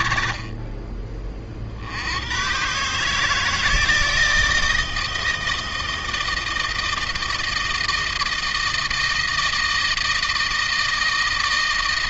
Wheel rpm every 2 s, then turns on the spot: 30, 150, 160, 160, 160, 160.
none